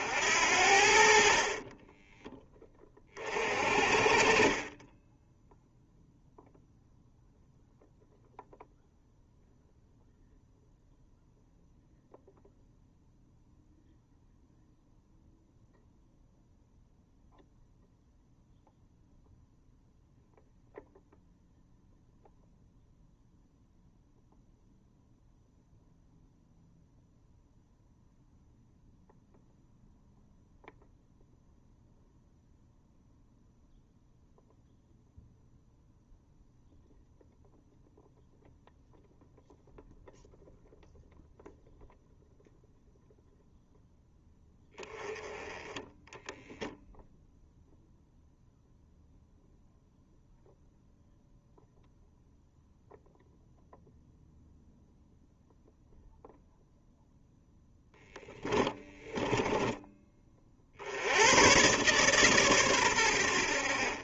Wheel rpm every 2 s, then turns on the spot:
60, 20, 20, 0, 0, 0, 0, 0, 0, 0, 0, 0, 0, 0, 0, 0, 0, 0, 0, 0, 0, 0, 10, 0, 0, 0, 0, 0, 0, 10, 60, 120.
58-60